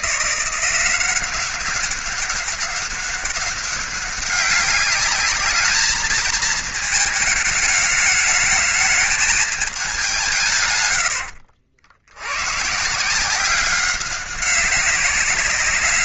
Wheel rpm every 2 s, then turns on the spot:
180, 200, 200, 220, 210, 110, 150, 190.
none